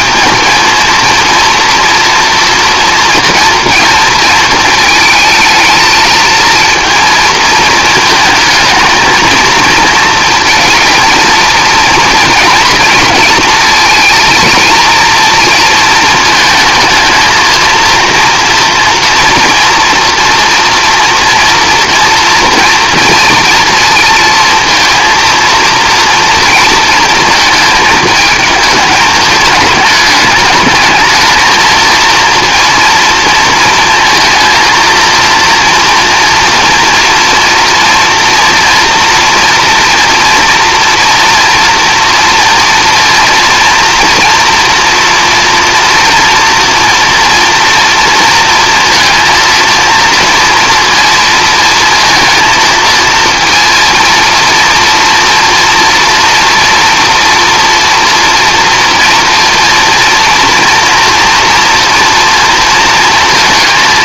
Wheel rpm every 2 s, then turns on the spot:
220, 230, 220, 230, 220, 230, 230, 230, 220, 240, 240, 230, 230, 230, 220, 220, 230, 230, 230, 230, 230, 240, 230, 230, 230, 230, 230, 230, 230, 230, 230, 230.
none